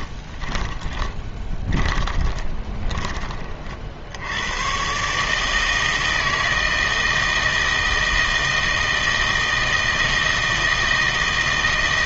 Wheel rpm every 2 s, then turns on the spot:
20, 20, 120, 160, 160, 160.
0-4